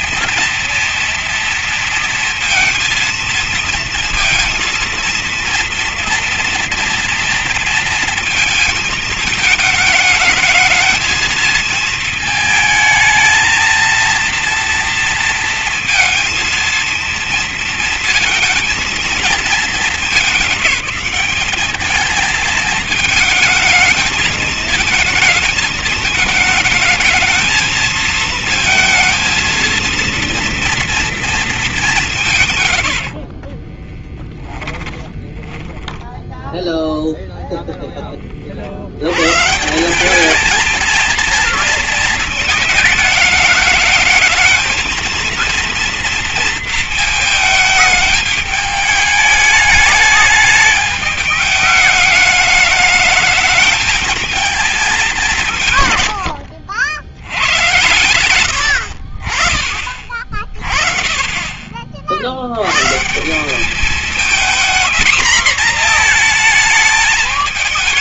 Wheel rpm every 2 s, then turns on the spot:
230, 230, 230, 230, 220, 230, 220, 230, 230, 220, 190, 220, 220, 220, 230, 230, 70, 10, 0, 90, 220, 210, 230, 230, 210, 210, 210, 200, 90, 60, 30, 140, 240, 220.
32-36